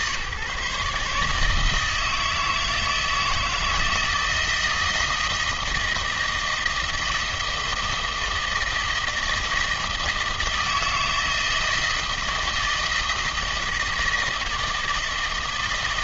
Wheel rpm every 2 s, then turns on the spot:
140, 160, 160, 160, 160, 160, 160, 160.
none